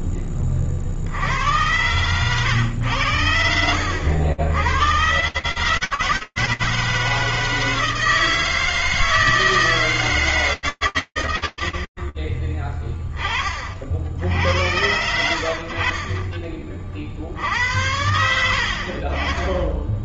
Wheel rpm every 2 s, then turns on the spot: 0, 100, 70, 150, 160, 120, 20, 90, 60, 60.
none